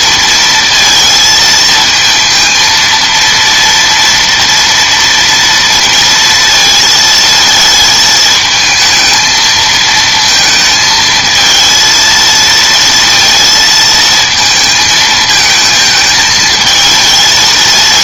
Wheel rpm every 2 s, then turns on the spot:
230, 230, 230, 220, 220, 220, 230, 220, 220.
none